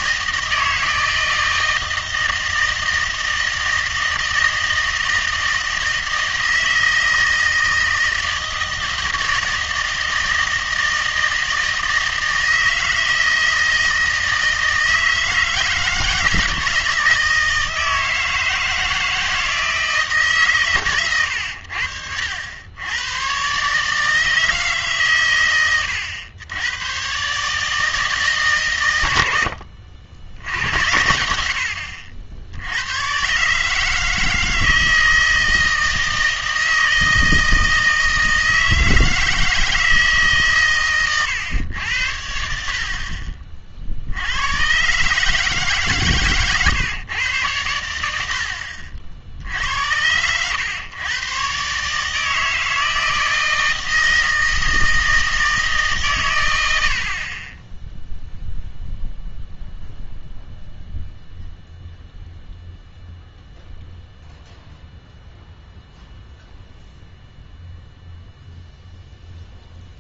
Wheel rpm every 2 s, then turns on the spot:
160, 160, 160, 160, 160, 160, 160, 160, 160, 160, 120, 90, 150, 110, 130, 90, 80, 160, 160, 160, 140, 70, 110, 130, 60, 110, 160, 160, 100, 0, 0, 0, 0, 0, 0.
48-50